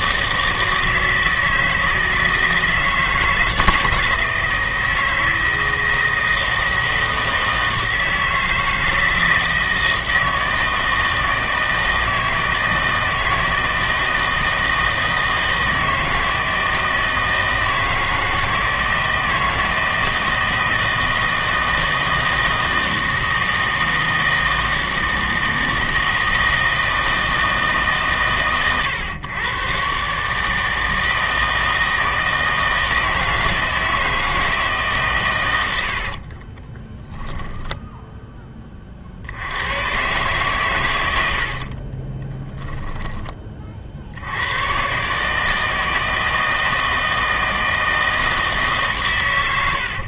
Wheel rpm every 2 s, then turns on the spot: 160, 160, 160, 160, 160, 160, 160, 160, 160, 160, 160, 160, 160, 160, 120, 160, 160, 150, 30, 30, 110, 10, 110, 160, 140.
36-38